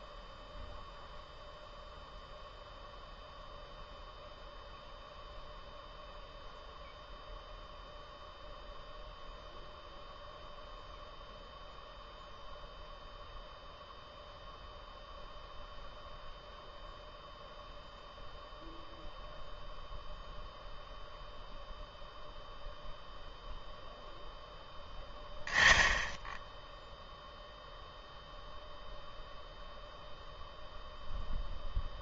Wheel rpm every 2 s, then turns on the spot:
0, 0, 0, 0, 0, 0, 0, 0, 0, 0, 0, 0, 10, 10, 0, 0.
none